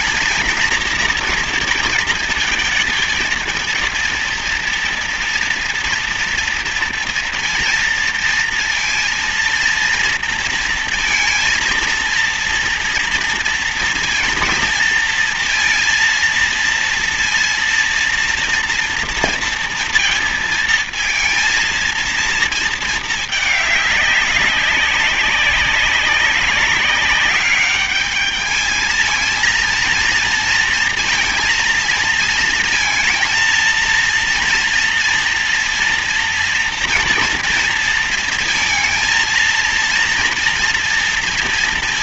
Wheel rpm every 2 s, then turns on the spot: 230, 220, 230, 240, 230, 230, 230, 230, 230, 230, 230, 230, 200, 190, 210, 230, 230, 230, 240, 230, 230.
none